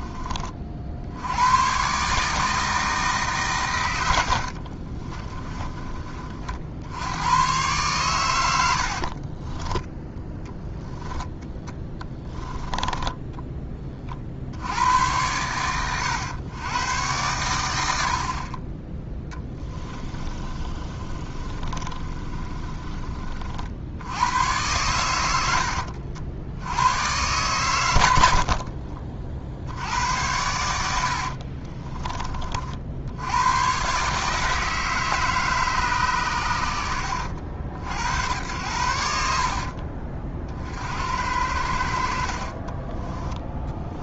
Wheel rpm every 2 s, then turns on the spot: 50, 160, 30, 60, 70, 0, 10, 100, 120, 20, 30, 30, 100, 100, 50, 80, 60, 160, 80, 80, 60, 20.
4-6 12-14 20-22 28-30 42-44